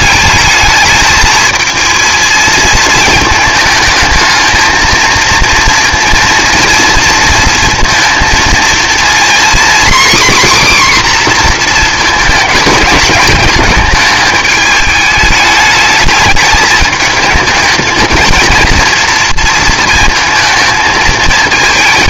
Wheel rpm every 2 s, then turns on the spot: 220, 220, 230, 230, 230, 260, 230, 210, 220, 230, 220.
none